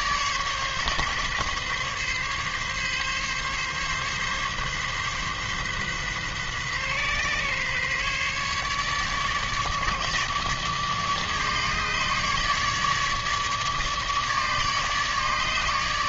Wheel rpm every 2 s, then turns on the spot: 140, 140, 140, 130, 150, 150, 150, 150.
none